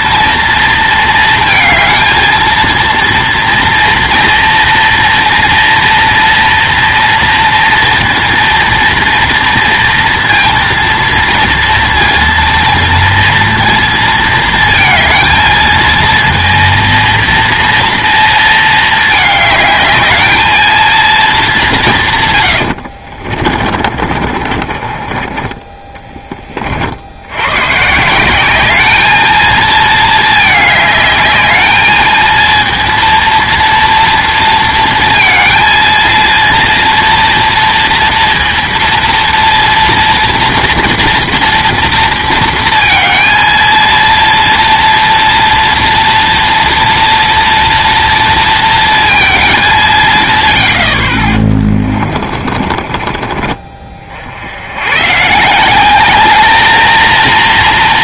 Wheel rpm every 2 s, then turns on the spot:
230, 230, 230, 230, 230, 230, 230, 230, 230, 220, 220, 110, 40, 40, 200, 210, 230, 230, 230, 230, 230, 230, 230, 230, 230, 80, 40, 80, 220.
22-26 52-54